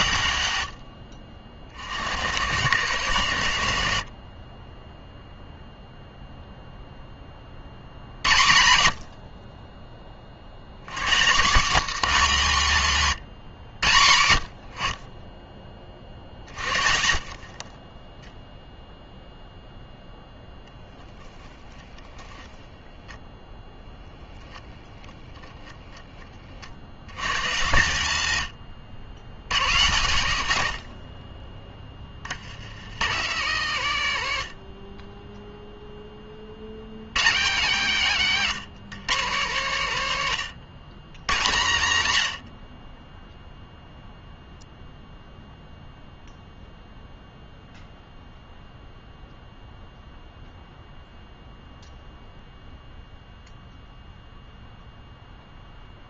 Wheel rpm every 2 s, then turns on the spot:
70, 130, 10, 0, 80, 100, 170, 60, 40, 0, 10, 10, 10, 70, 90, 70, 80, 50, 90, 180, 130, 50, 0, 0, 0, 0, 0, 0.
22-24 28-30